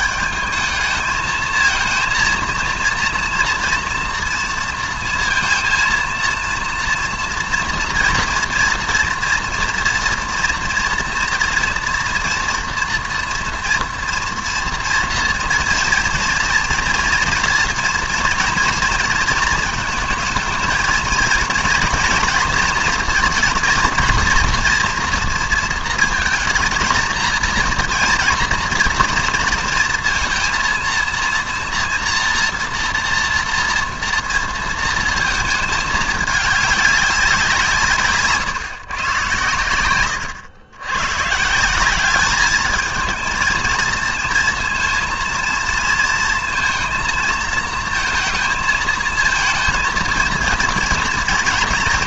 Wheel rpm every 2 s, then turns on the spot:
220, 230, 230, 230, 230, 240, 230, 230, 230, 230, 220, 240, 230, 230, 230, 230, 230, 230, 210, 140, 110, 210, 230, 230, 220, 230.
none